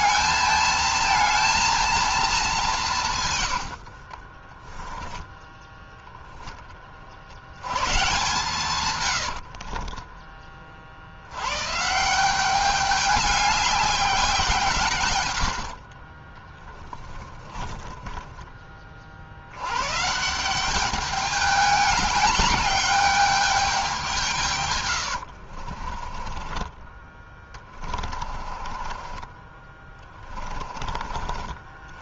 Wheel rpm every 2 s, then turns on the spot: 230, 180, 10, 30, 120, 50, 200, 130, 20, 40, 200, 200, 110, 20, 30, 50.
4-6 8-10 14-18 24-26 28-30